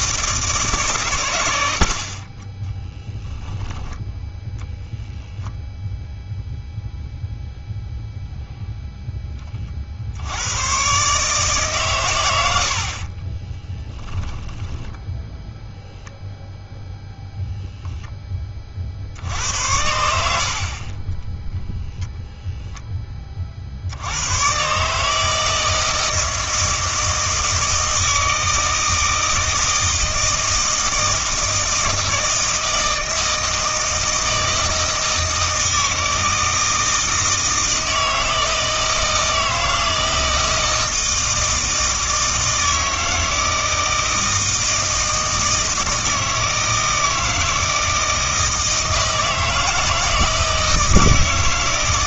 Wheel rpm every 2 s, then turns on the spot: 150, 10, 10, 0, 0, 110, 70, 10, 0, 50, 30, 10, 140, 160, 160, 160, 160, 160, 160, 160, 160, 160, 160, 160, 160, 160.
12-16